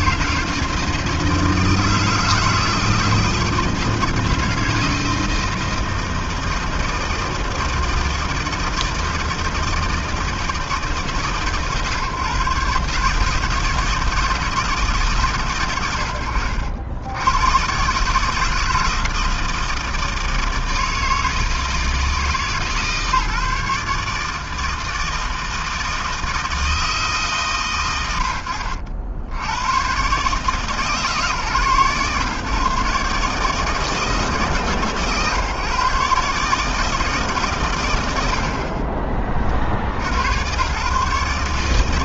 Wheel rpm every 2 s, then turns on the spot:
160, 160, 160, 160, 160, 130, 150, 120, 90, 160, 160, 150, 160, 130, 80, 130, 150, 140, 140, 60, 150.
none